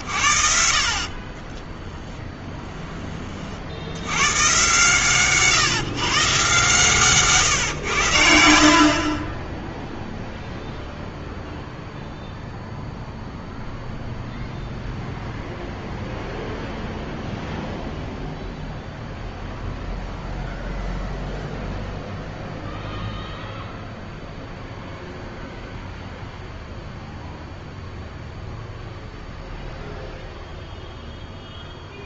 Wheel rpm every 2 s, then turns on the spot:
40, 20, 130, 140, 60, 0, 0, 0, 0, 0, 0, 0, 0, 0, 0, 0.
none